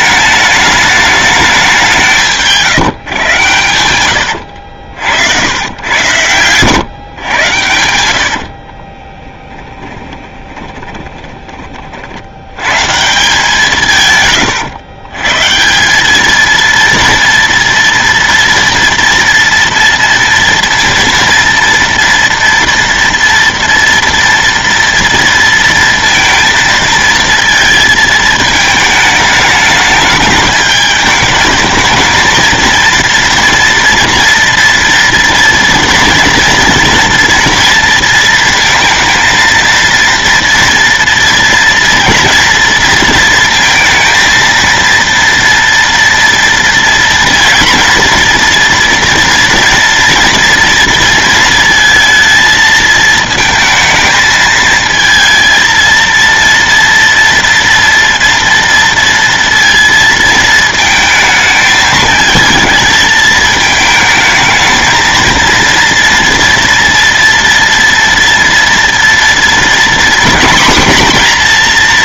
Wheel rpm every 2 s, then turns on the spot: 210, 150, 70, 130, 40, 20, 140, 120, 230, 230, 230, 230, 230, 230, 220, 210, 230, 230, 230, 230, 230, 230, 230, 230, 230, 230, 220, 220, 230, 230, 220, 220, 220, 230, 230, 250.
8-12